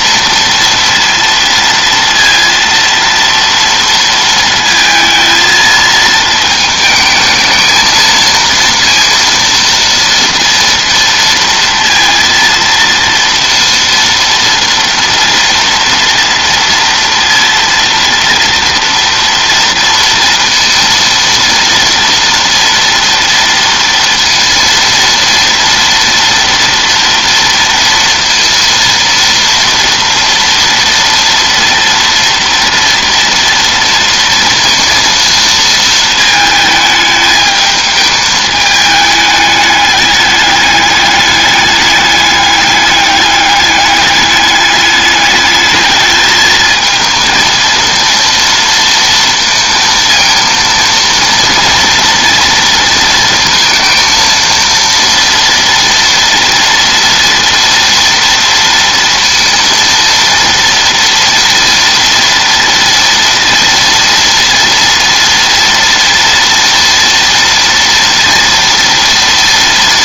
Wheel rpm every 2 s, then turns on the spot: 230, 230, 230, 220, 230, 230, 230, 230, 230, 230, 230, 230, 230, 230, 230, 230, 230, 230, 220, 210, 210, 210, 210, 220, 230, 230, 230, 230, 230, 230, 230, 230, 230, 230, 230.
none